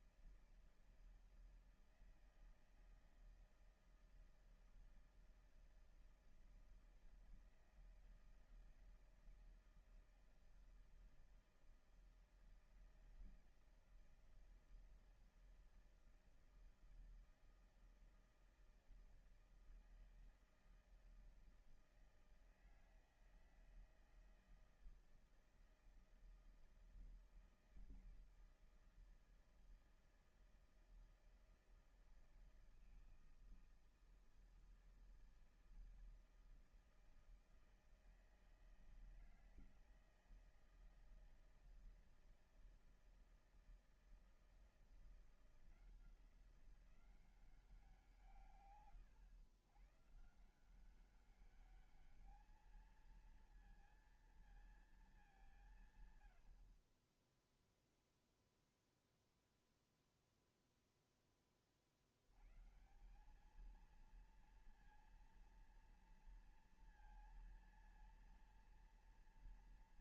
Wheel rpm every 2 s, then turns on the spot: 160, 160, 160, 160, 160, 160, 160, 160, 160, 160, 160, 160, 160, 160, 160, 160, 160, 160, 160, 160, 160, 160, 160, 170, 160, 140, 210, 230, 110, 0, 0, 90, 230, 230, 230.
none